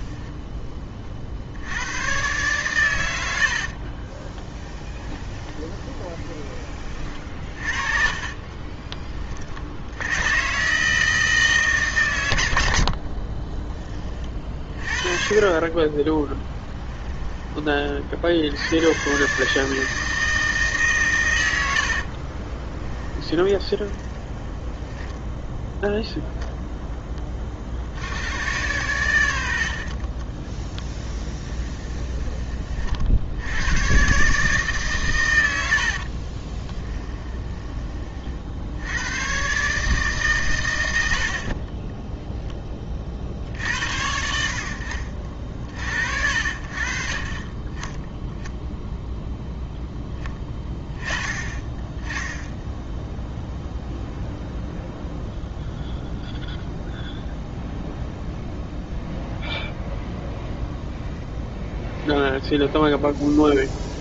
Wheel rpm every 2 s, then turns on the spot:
30, 120, 10, 30, 30, 150, 60, 40, 10, 110, 140, 10, 0, 0, 100, 20, 50, 130, 20, 90, 90, 30, 60, 50, 10, 20, 0, 0, 0, 0, 0, 0.
4-6 12-14 16-18 22-24 30-32 36-38